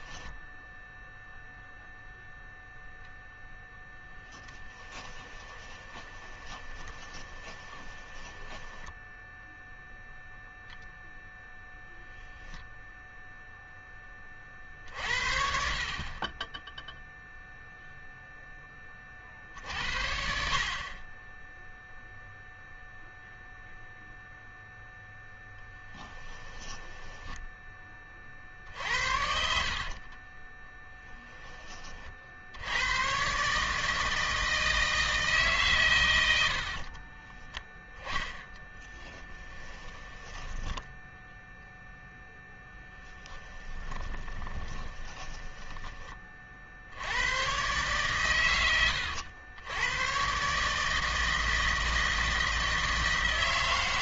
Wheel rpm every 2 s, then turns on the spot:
0, 0, 10, 20, 10, 0, 0, 50, 0, 20, 40, 0, 0, 10, 60, 10, 100, 160, 50, 20, 10, 10, 20, 70, 100, 150, 160.
4-10 26-28 36-46